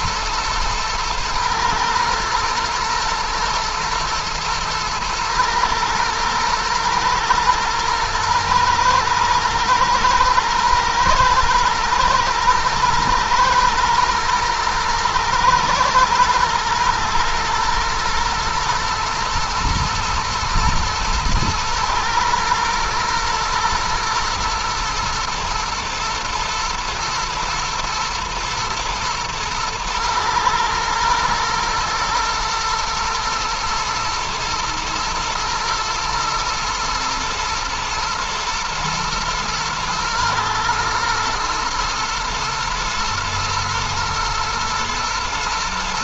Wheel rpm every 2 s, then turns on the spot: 110, 120, 110, 110, 110, 110, 110, 120, 120, 110, 110, 120, 110, 110, 120, 110, 110, 120, 110, 120, 120, 110, 110.
none